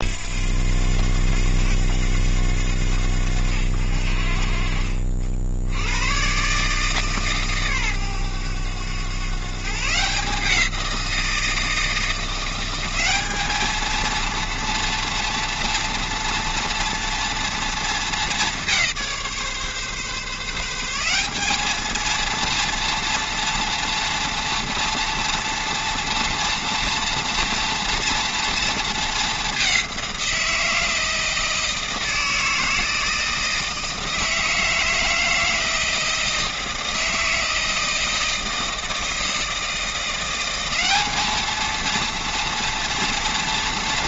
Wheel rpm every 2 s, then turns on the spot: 80, 90, 50, 140, 110, 170, 180, 230, 230, 200, 160, 230, 230, 230, 230, 170, 160, 160, 160, 160, 180, 230.
none